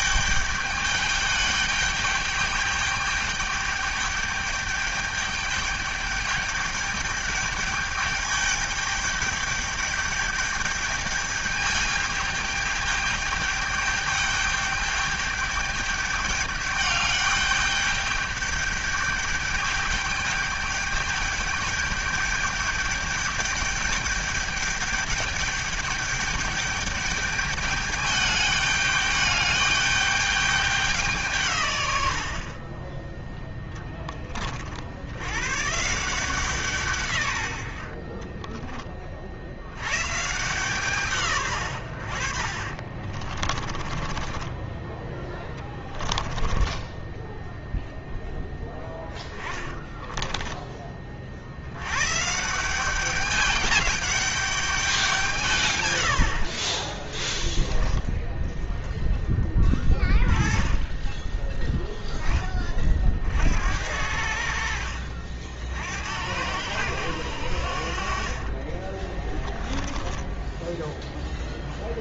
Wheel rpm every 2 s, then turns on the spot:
210, 210, 210, 210, 210, 210, 210, 210, 210, 210, 210, 210, 210, 210, 210, 200, 50, 60, 150, 20, 140, 50, 20, 10, 10, 20, 170, 200, 50, 10, 20, 20, 70, 90, 40, 0.
42-48 68-70